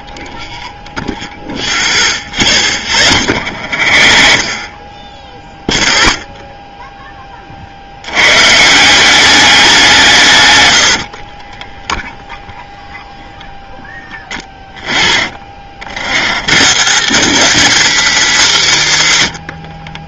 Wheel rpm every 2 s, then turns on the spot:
0, 30, 10, 30, 190, 50, 0, 30, 150, 110.
2-4 10-12